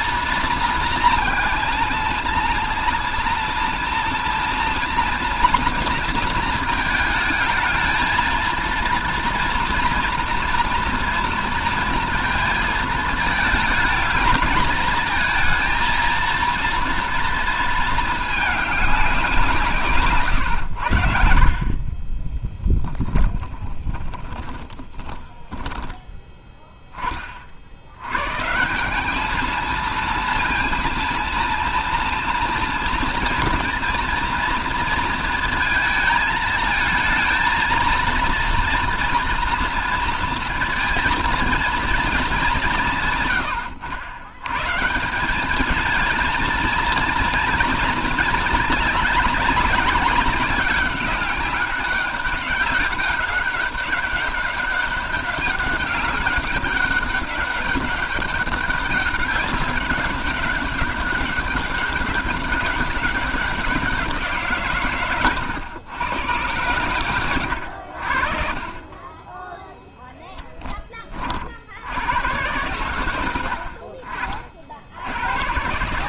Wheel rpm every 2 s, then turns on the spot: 230, 230, 230, 220, 230, 230, 220, 220, 230, 210, 100, 20, 20, 10, 150, 230, 230, 230, 220, 230, 230, 180, 130, 220, 210, 200, 200, 200, 200, 200, 190, 190, 150, 110, 40, 20, 110, 60.
22-26